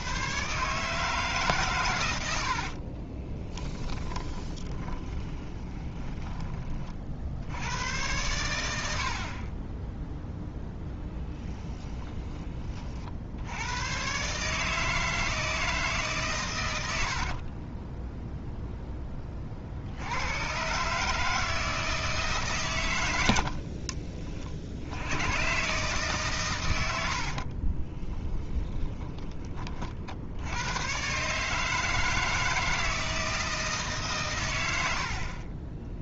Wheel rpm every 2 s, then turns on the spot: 150, 30, 20, 40, 60, 10, 50, 160, 90, 10, 140, 110, 80, 80, 10, 120, 160, 70.
2-6 26-28